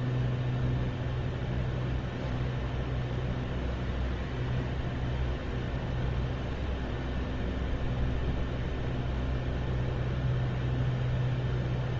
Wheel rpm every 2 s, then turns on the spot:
0, 0, 0, 0, 0, 0.
none